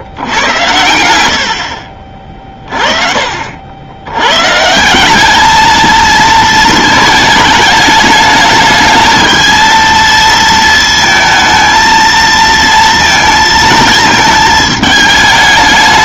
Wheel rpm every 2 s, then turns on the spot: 90, 30, 150, 220, 220, 220, 230, 220.
none